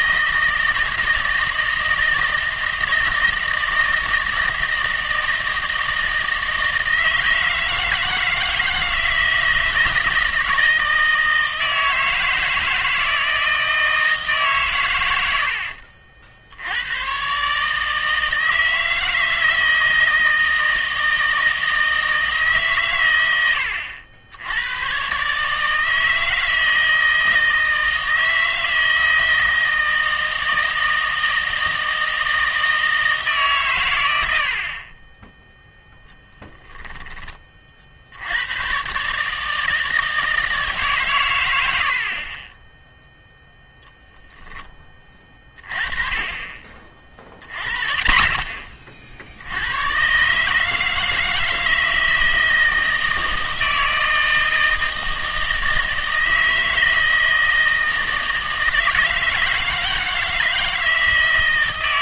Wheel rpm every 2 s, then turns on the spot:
160, 160, 160, 160, 160, 160, 160, 130, 80, 160, 160, 140, 100, 160, 160, 160, 160, 50, 10, 120, 150, 10, 10, 30, 40, 150, 160, 160, 160, 160, 160.
36-38